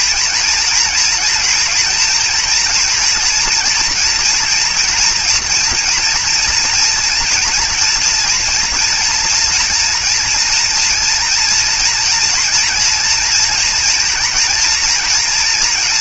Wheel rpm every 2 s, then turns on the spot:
230, 230, 230, 240, 240, 230, 240, 230.
none